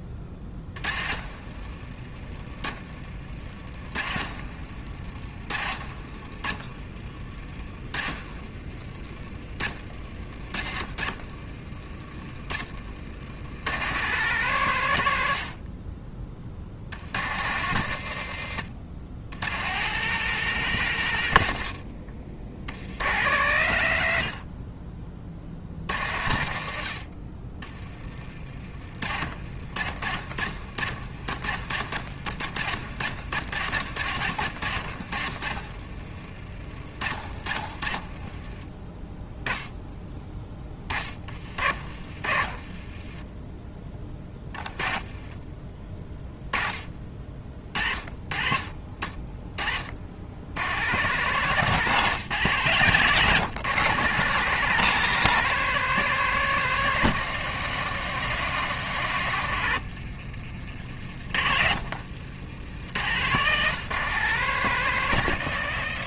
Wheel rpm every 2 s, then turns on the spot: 40, 40, 50, 40, 40, 50, 60, 100, 80, 100, 140, 90, 40, 60, 60, 60, 70, 80, 50, 10, 30, 30, 20, 30, 30, 130, 140, 170, 150, 110, 60, 100, 140.
0-12 28-32 34-38 40-46 52-54 60-62